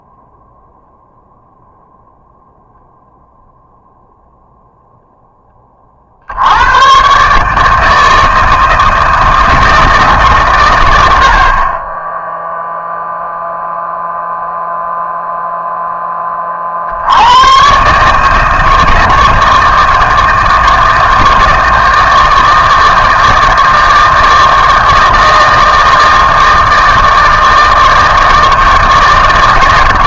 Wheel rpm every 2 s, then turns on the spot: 0, 0, 0, 90, 160, 120, 0, 0, 50, 160, 160, 160, 160, 160, 160.
none